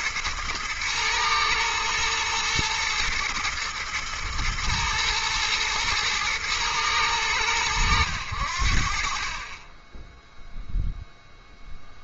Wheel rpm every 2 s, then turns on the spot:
120, 110, 120, 110, 70, 0.
none